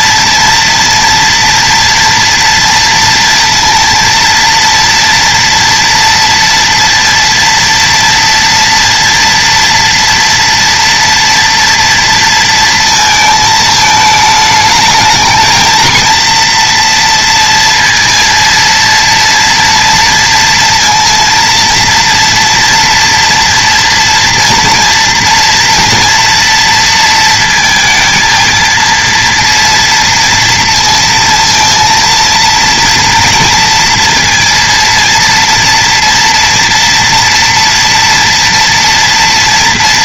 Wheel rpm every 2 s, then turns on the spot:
230, 230, 230, 230, 240, 230, 230, 210, 230, 230, 230, 230, 230, 230, 230, 230, 230, 230, 240, 230.
none